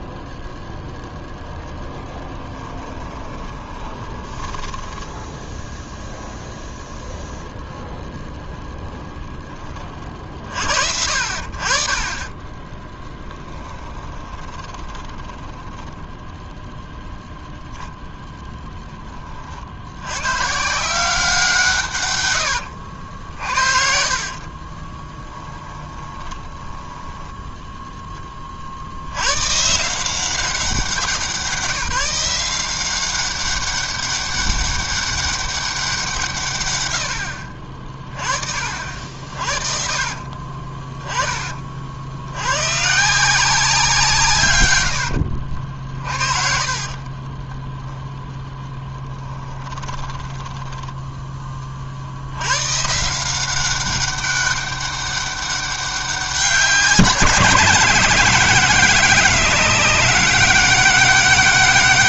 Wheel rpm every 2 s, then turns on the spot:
0, 10, 10, 0, 0, 60, 10, 20, 0, 0, 170, 80, 30, 10, 70, 180, 180, 200, 90, 50, 30, 130, 100, 30, 10, 10, 130, 200, 170, 190, 200.
2-4 12-16 22-28 40-42 46-48